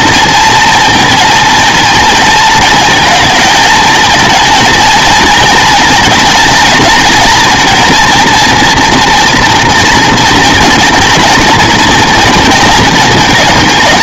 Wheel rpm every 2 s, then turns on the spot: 230, 220, 230, 230, 240, 230, 220.
none